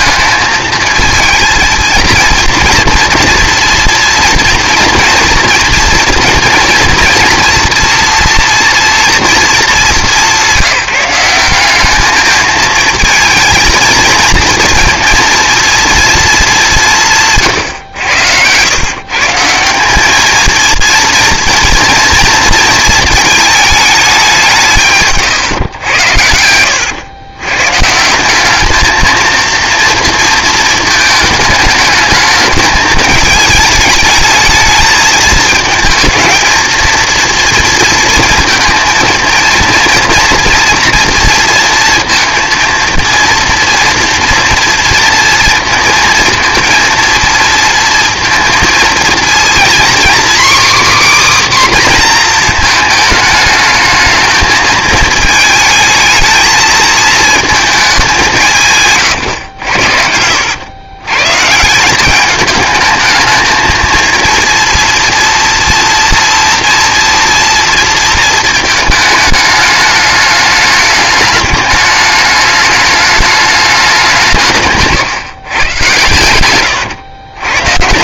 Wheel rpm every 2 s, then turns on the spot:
220, 230, 240, 230, 230, 170, 220, 230, 200, 110, 220, 230, 170, 100, 210, 220, 220, 220, 230, 230, 230, 230, 230, 230, 230, 280, 230, 220, 220, 150, 100, 210, 230, 230, 220, 210, 210, 150, 120.
26-28 76-78